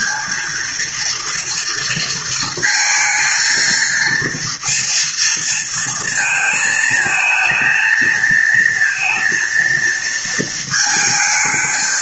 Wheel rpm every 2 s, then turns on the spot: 230, 220, 230, 220, 220, 220.
none